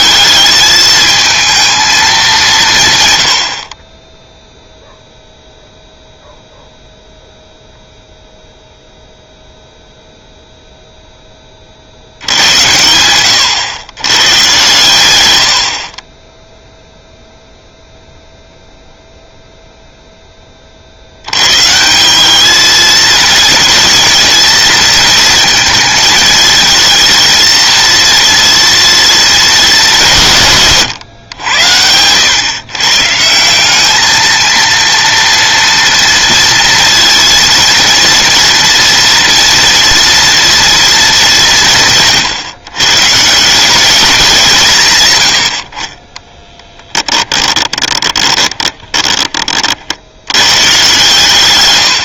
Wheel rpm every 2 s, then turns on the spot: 220, 140, 0, 0, 0, 0, 90, 120, 0, 0, 50, 220, 220, 230, 230, 130, 130, 230, 230, 230, 230, 140, 130, 10, 20, 120.
46-50